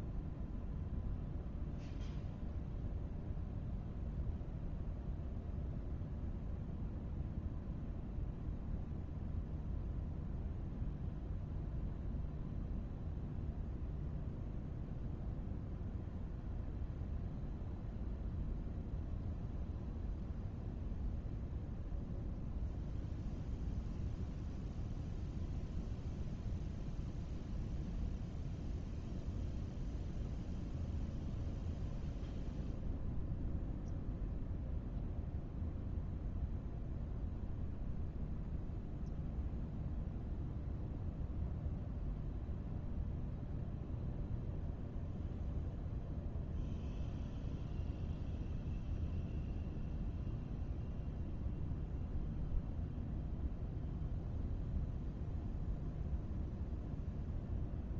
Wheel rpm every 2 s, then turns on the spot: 0, 0, 0, 0, 0, 0, 0, 0, 0, 0, 0, 0, 0, 0, 0, 0, 0, 0, 0, 0, 0, 0, 0, 0, 0, 0, 0, 0, 0.
none